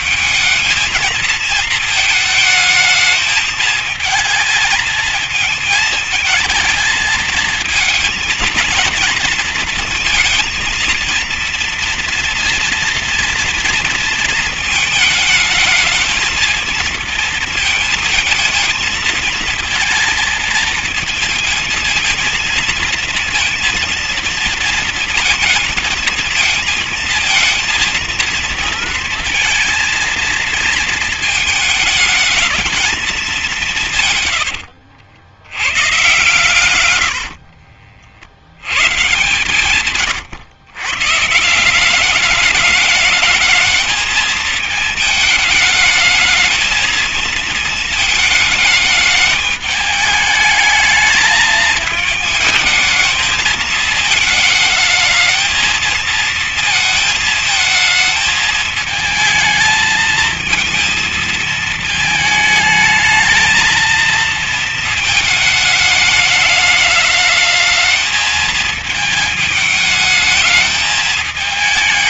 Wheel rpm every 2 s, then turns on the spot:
220, 220, 220, 220, 230, 230, 240, 220, 220, 230, 230, 230, 230, 220, 230, 220, 220, 100, 120, 90, 130, 210, 220, 220, 220, 210, 220, 220, 230, 220, 220, 220, 230, 210, 220, 210.
34-38